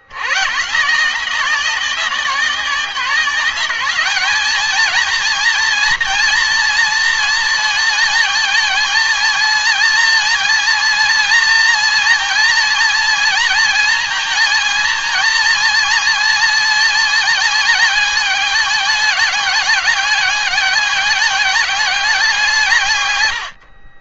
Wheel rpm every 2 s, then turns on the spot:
120, 190, 210, 230, 220, 230, 230, 230, 230, 210, 200, 170.
none